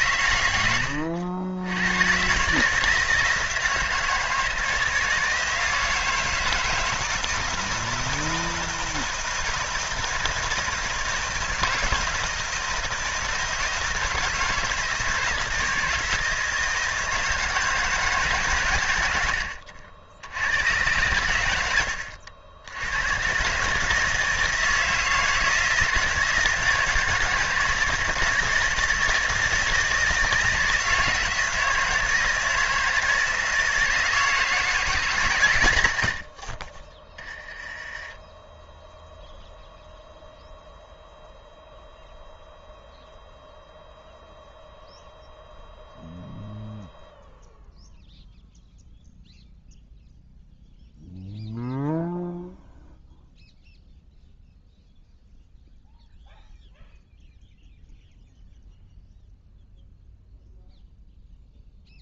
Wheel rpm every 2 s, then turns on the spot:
90, 150, 160, 160, 160, 160, 160, 160, 160, 110, 100, 90, 160, 160, 160, 160, 160, 160, 30, 0, 0, 0, 0, 0, 0, 0, 0, 0, 0, 0, 0.
none